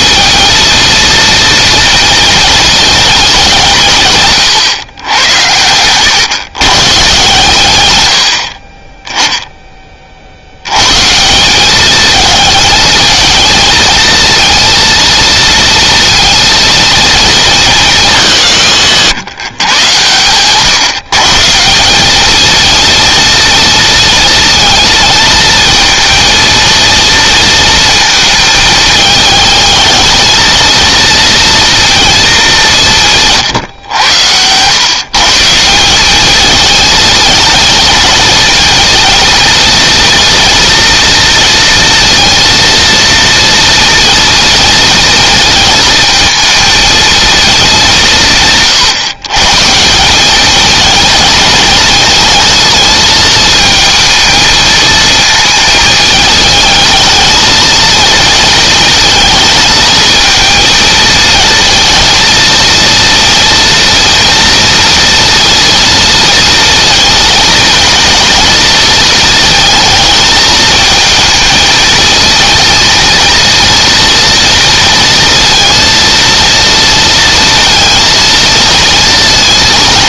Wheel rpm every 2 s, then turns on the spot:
230, 220, 120, 140, 20, 130, 230, 230, 230, 150, 130, 230, 220, 230, 220, 230, 170, 120, 220, 230, 230, 230, 230, 220, 140, 220, 220, 220, 220, 220, 220, 230, 230, 230, 230, 220, 230, 230, 230, 230.
none